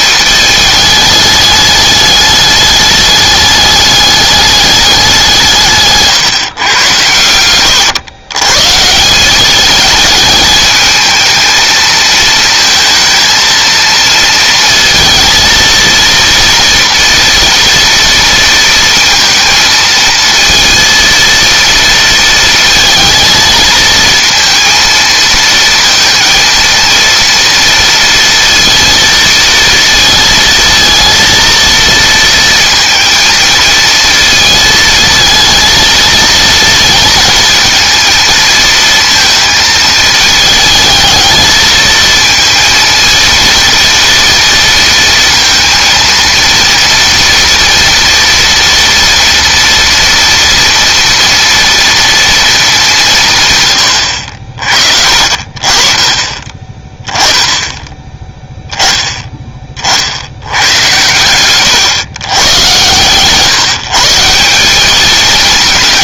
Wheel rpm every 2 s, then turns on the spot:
220, 210, 200, 110, 160, 220, 230, 230, 230, 230, 230, 220, 230, 230, 230, 230, 220, 230, 230, 230, 220, 230, 230, 230, 240, 230, 190, 50, 20, 10, 110, 120, 210.
none